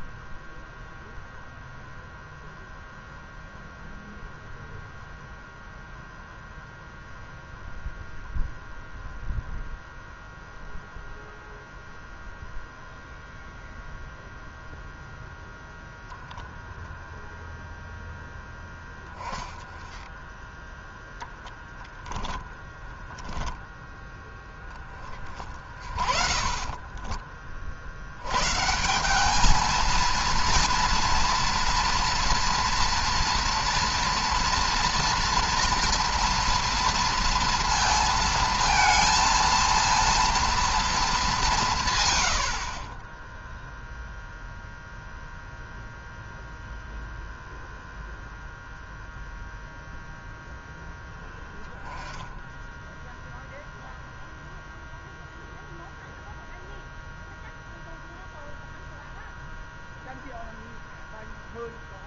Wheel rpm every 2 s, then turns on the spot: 0, 0, 0, 0, 0, 0, 0, 0, 0, 10, 0, 20, 20, 20, 170, 230, 230, 230, 230, 230, 220, 30, 0, 0, 0, 10, 10, 0, 0, 0, 0.
22-24 26-28